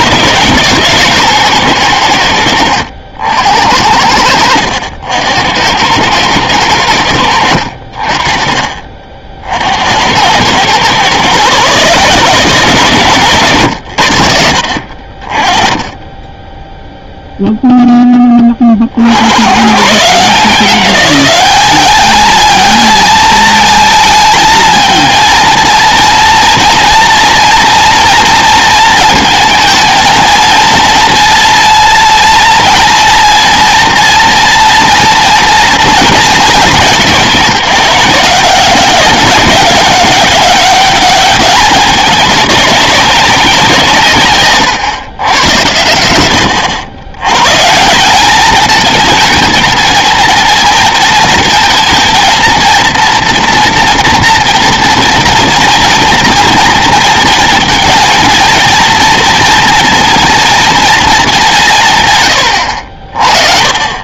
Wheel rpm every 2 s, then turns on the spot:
150, 80, 70, 90, 30, 120, 150, 60, 0, 40, 180, 220, 220, 230, 230, 230, 230, 230, 190, 190, 200, 200, 130, 100, 230, 230, 230, 230, 230, 220, 230, 80.
8-10